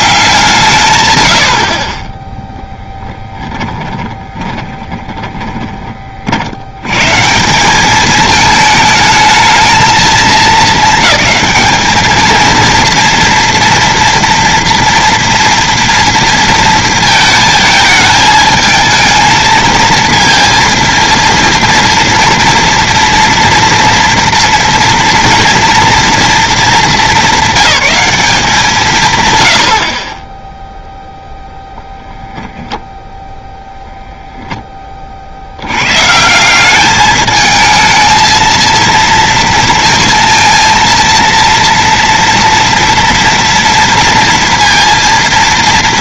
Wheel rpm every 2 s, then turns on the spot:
140, 10, 20, 100, 220, 220, 230, 240, 230, 220, 230, 240, 230, 220, 170, 0, 0, 10, 200, 230, 230, 230, 230.
2-6